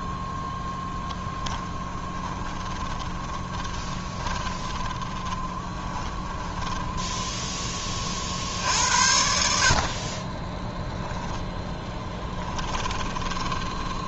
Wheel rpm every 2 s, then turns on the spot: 0, 20, 20, 10, 60, 10, 10.
2-8 10-14